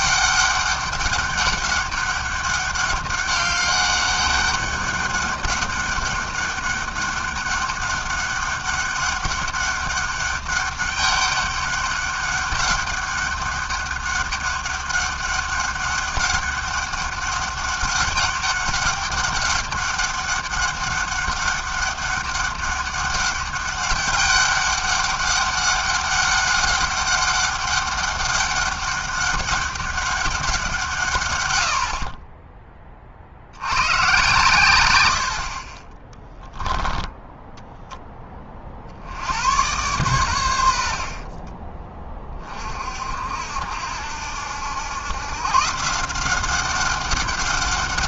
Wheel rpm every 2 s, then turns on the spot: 200, 200, 200, 200, 200, 200, 200, 190, 200, 200, 200, 200, 200, 200, 200, 110, 60, 70, 10, 80, 30, 60, 120, 190.
36-38 40-42